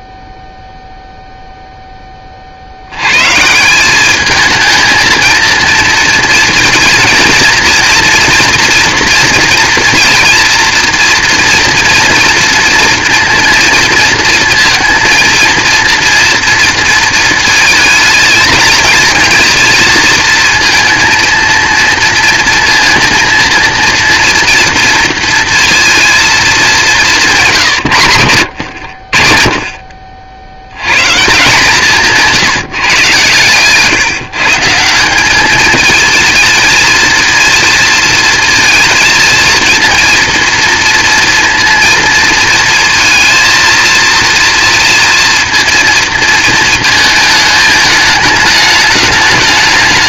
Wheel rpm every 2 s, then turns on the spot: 0, 60, 220, 230, 230, 230, 230, 230, 230, 230, 230, 230, 230, 210, 80, 90, 150, 160, 230, 230, 230, 230, 230, 220, 210.
none